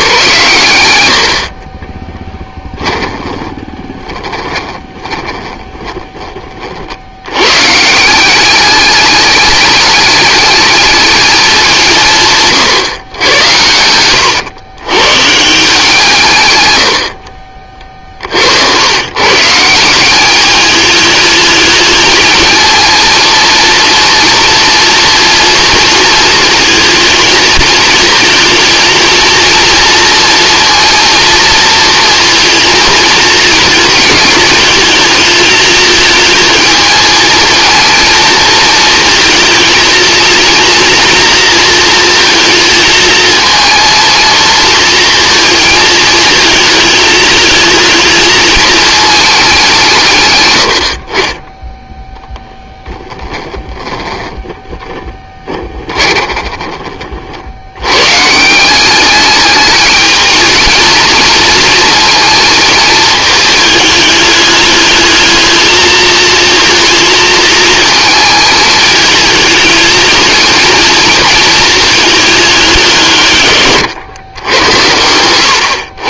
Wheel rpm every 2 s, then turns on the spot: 100, 20, 20, 70, 210, 220, 130, 130, 90, 110, 220, 230, 240, 220, 230, 230, 230, 220, 220, 230, 230, 230, 230, 220, 220, 90, 30, 20, 40, 200, 230, 220, 210, 230, 220, 230, 160, 100.
2-6 12-14 16-18 52-56 74-76